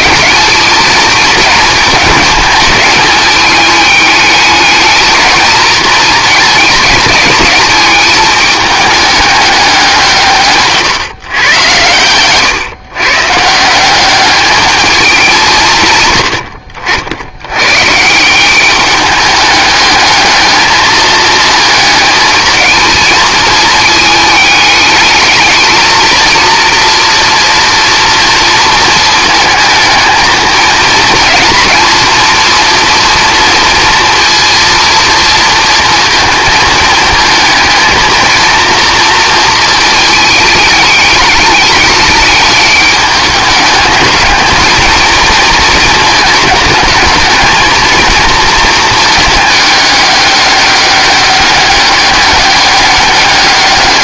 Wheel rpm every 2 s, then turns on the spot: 220, 220, 220, 210, 210, 150, 130, 210, 70, 200, 220, 220, 210, 230, 230, 220, 230, 230, 220, 230, 220, 210, 220, 220, 220, 200, 200.
none